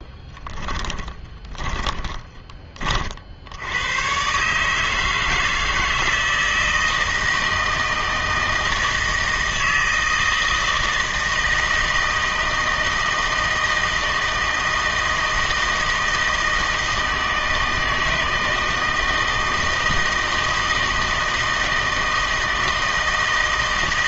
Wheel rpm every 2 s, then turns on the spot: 20, 30, 150, 160, 160, 160, 160, 160, 160, 160, 160, 160.
0-2